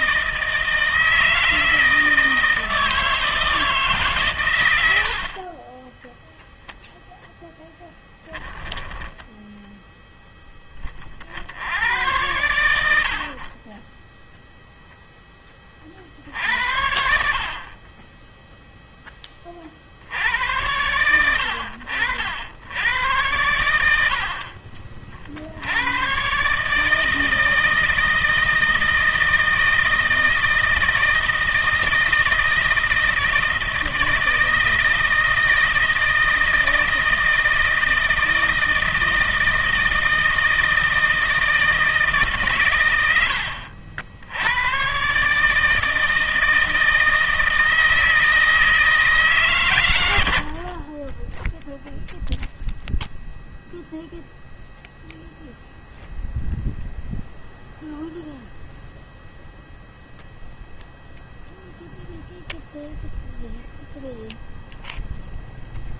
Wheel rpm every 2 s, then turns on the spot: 160, 160, 80, 0, 10, 20, 90, 0, 70, 10, 100, 90, 50, 150, 160, 160, 160, 160, 160, 160, 160, 120, 120, 160, 160, 20, 0, 0, 0, 0, 0, 0, 0.
8-10